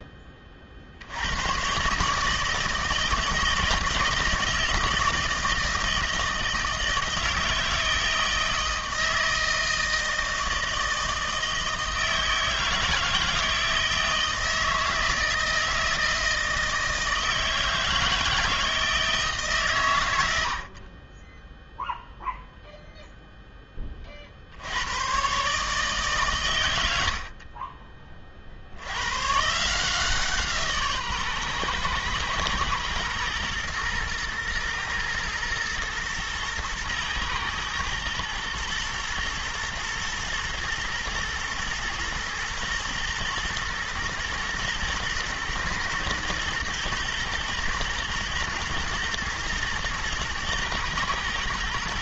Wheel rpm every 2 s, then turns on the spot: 50, 160, 160, 160, 160, 160, 160, 160, 160, 160, 50, 0, 90, 80, 70, 150, 110, 110, 110, 110, 120, 120, 120, 110, 120, 120.
none